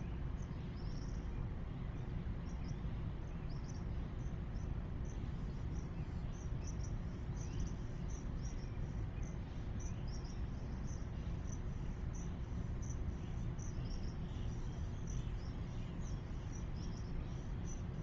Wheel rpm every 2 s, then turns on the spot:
0, 0, 0, 0, 0, 0, 0, 0, 0.
none